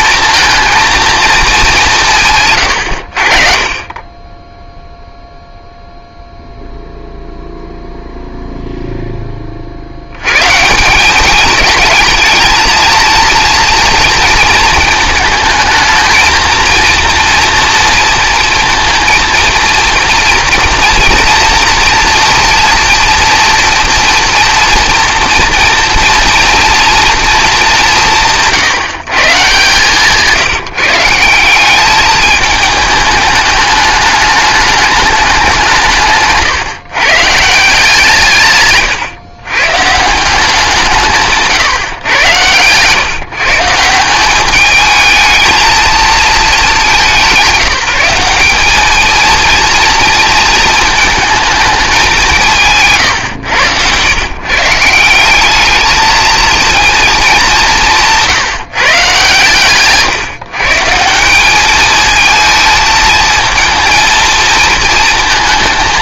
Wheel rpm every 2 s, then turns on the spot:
230, 120, 10, 0, 0, 140, 230, 220, 230, 230, 240, 230, 230, 230, 160, 170, 210, 210, 140, 140, 180, 130, 200, 210, 200, 220, 150, 150, 230, 160, 150, 220, 230.
none